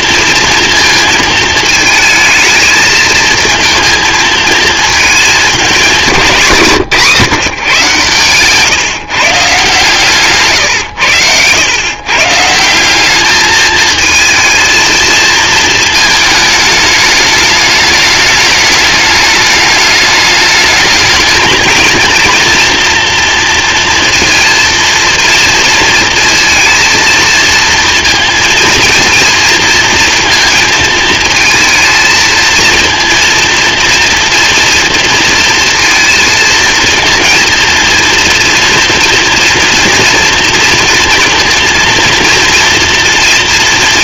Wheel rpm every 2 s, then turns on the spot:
230, 220, 220, 170, 150, 120, 190, 230, 210, 210, 220, 230, 230, 230, 230, 230, 230, 230, 230, 240, 230, 230.
none